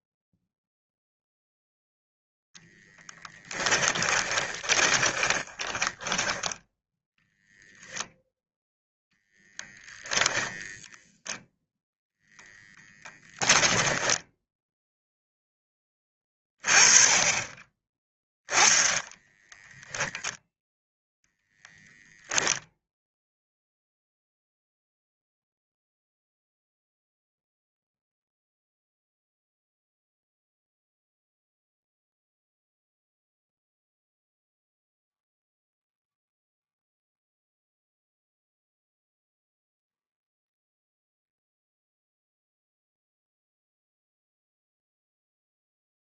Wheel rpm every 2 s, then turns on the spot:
0, 0, 20, 0, 0, 0, 10, 0, 20, 10, 10, 0, 0, 0, 0, 0, 0, 0, 0, 0, 0, 0, 0.
4-6 12-14